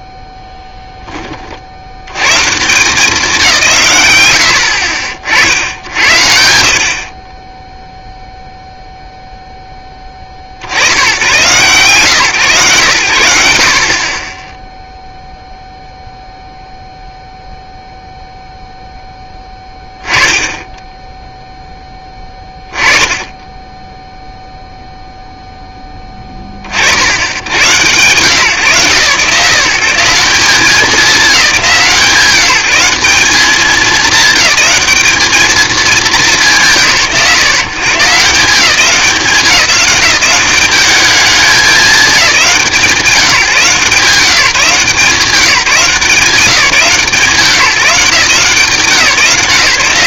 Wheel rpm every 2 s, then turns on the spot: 0, 140, 100, 80, 0, 60, 120, 10, 0, 0, 10, 10, 0, 20, 120, 180, 160, 210, 160, 180, 190, 180, 170, 180, 170.
none